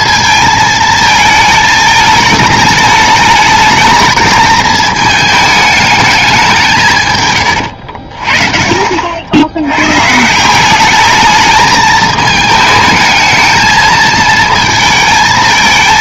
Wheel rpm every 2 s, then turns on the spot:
220, 210, 220, 190, 40, 180, 220, 220.
none